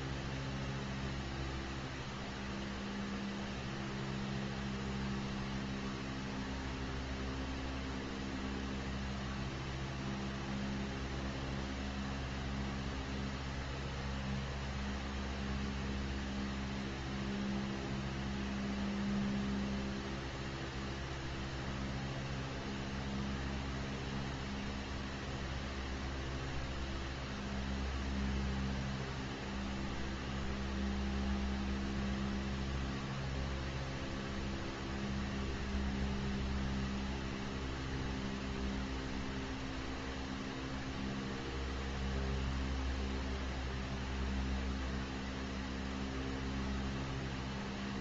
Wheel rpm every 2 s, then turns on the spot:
0, 0, 0, 0, 0, 0, 0, 0, 0, 0, 0, 0, 0, 0, 0, 0, 0, 0, 0, 0, 0, 0, 0, 0.
none